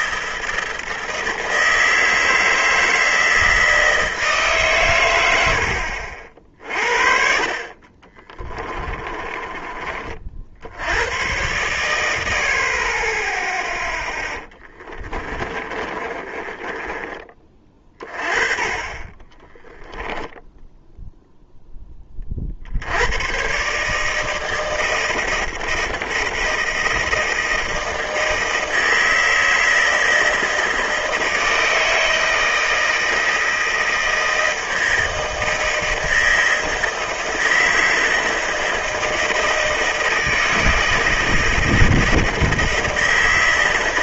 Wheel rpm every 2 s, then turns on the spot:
160, 160, 130, 50, 20, 80, 40, 20, 20, 20, 0, 70, 160, 160, 160, 160, 160, 160, 160, 160, 160, 160.
8-10 14-18